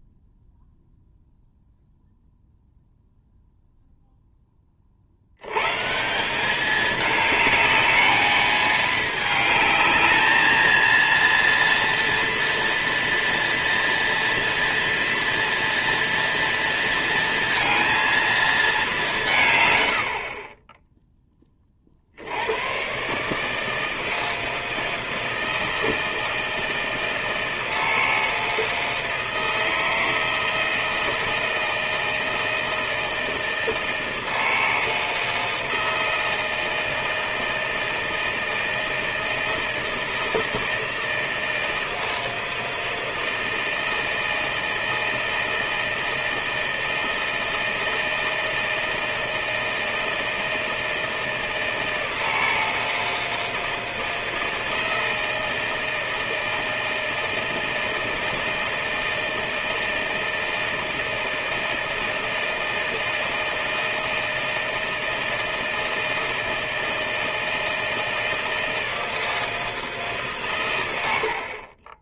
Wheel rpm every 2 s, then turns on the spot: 0, 0, 50, 210, 220, 230, 230, 230, 230, 180, 10, 120, 160, 160, 160, 160, 160, 160, 160, 160, 160, 160, 160, 160, 160, 160, 160, 160, 160, 160, 160, 160, 160, 160, 160, 90.
none